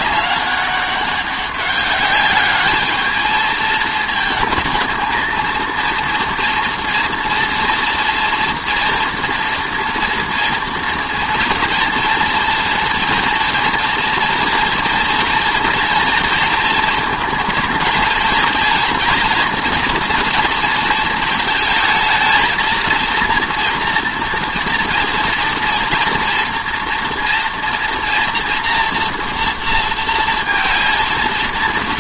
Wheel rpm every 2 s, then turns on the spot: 200, 210, 220, 230, 230, 230, 230, 230, 230, 230, 230, 230, 230, 230, 230, 230.
none